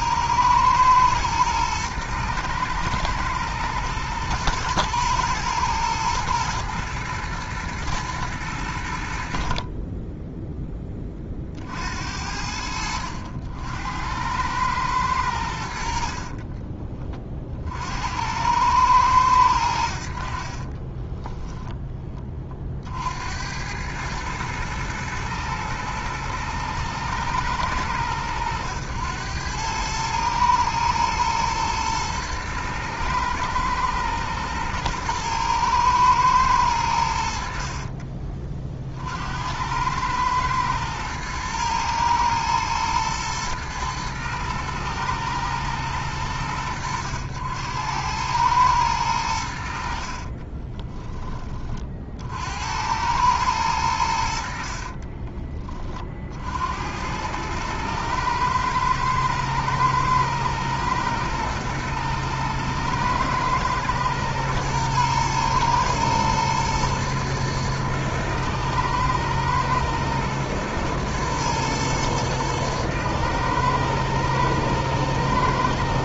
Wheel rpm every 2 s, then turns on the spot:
110, 120, 110, 110, 80, 20, 70, 100, 30, 110, 30, 60, 110, 110, 100, 110, 110, 110, 90, 50, 110, 110, 110, 90, 100, 20, 90, 40, 80, 110, 120, 110, 110, 120, 110, 110, 110, 110.
20-22 50-52 54-56